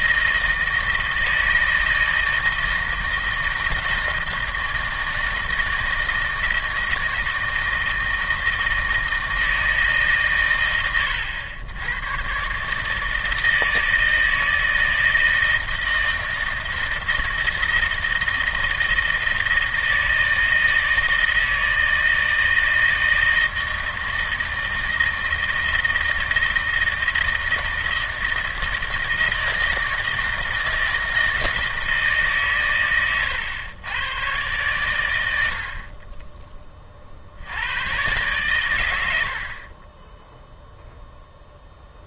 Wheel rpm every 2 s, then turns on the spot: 160, 160, 160, 160, 160, 120, 140, 160, 160, 160, 160, 160, 160, 160, 160, 160, 130, 110, 20, 110, 0.
none